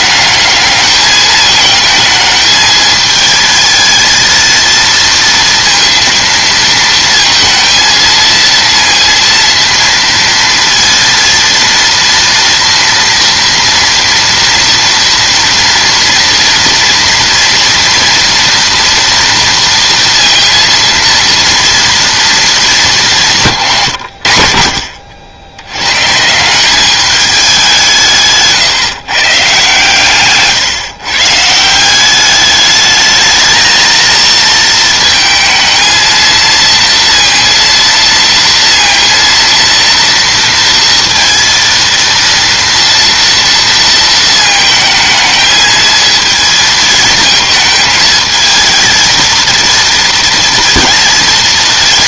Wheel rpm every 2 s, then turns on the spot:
210, 220, 230, 230, 230, 230, 230, 230, 240, 230, 230, 210, 50, 190, 150, 130, 210, 220, 230, 230, 230, 230, 220, 220, 220, 230.
none